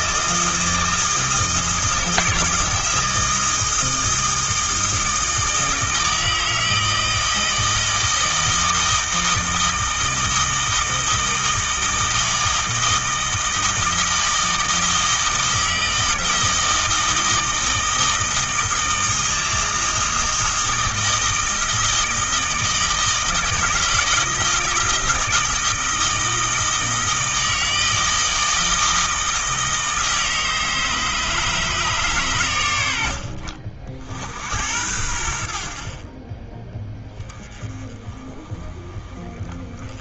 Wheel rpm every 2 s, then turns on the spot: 160, 160, 160, 160, 160, 160, 160, 160, 160, 160, 160, 160, 160, 160, 160, 150, 80, 80, 10, 20.
none